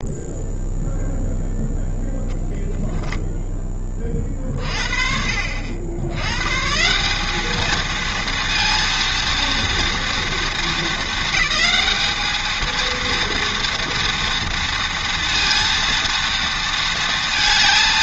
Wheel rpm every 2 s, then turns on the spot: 0, 0, 40, 130, 230, 230, 220, 230, 230.
none